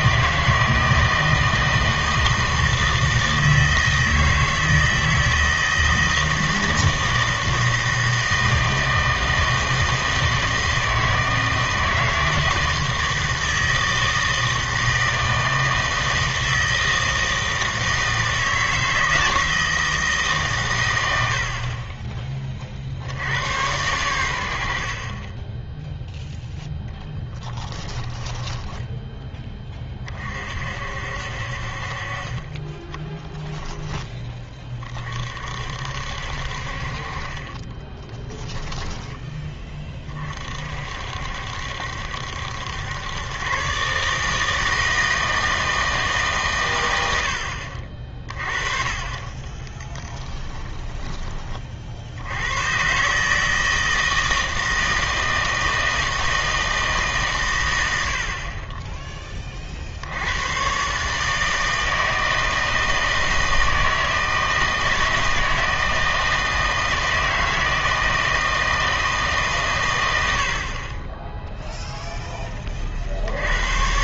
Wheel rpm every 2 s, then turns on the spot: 160, 160, 160, 160, 160, 160, 160, 160, 160, 160, 110, 50, 60, 0, 10, 60, 20, 30, 50, 10, 50, 90, 160, 120, 30, 10, 120, 160, 160, 20, 120, 160, 160, 160, 160, 40, 30.
28-30 38-40 50-52